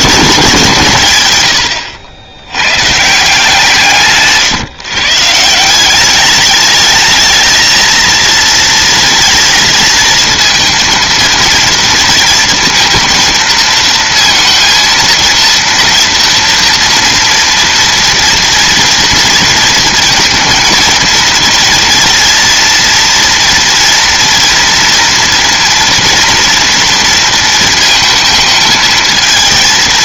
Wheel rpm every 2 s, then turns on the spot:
170, 120, 140, 210, 230, 230, 230, 230, 230, 230, 230, 230, 230, 230, 220.
none